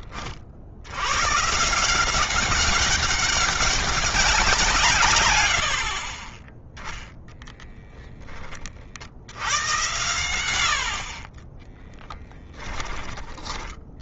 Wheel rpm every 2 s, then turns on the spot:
100, 190, 130, 0, 50, 60, 20.
none